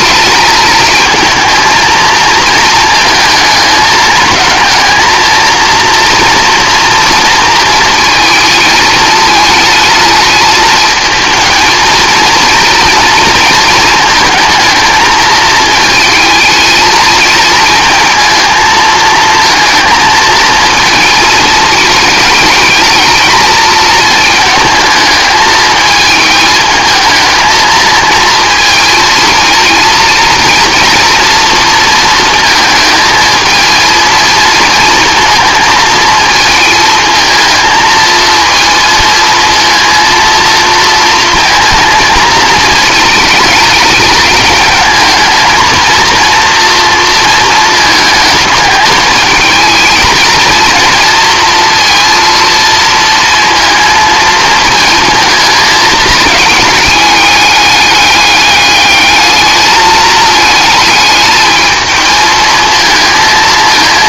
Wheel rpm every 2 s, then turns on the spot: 220, 220, 220, 230, 220, 220, 230, 230, 220, 220, 220, 220, 220, 220, 220, 230, 220, 230, 220, 230, 230, 230, 220, 230, 220, 230, 230, 220, 210, 210, 220, 220.
none